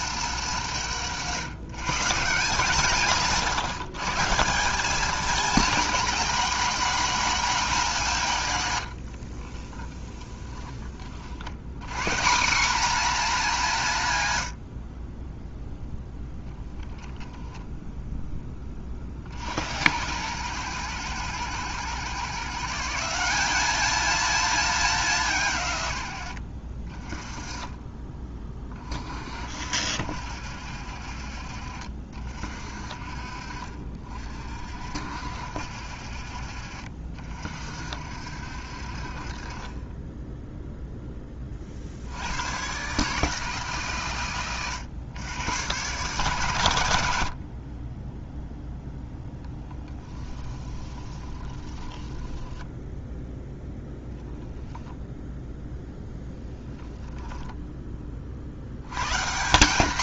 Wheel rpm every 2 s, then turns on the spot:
180, 170, 200, 230, 100, 30, 230, 60, 0, 20, 110, 170, 200, 40, 30, 60, 40, 60, 50, 50, 0, 130, 110, 110, 0, 20, 10, 0, 10, 100.
8-10 50-54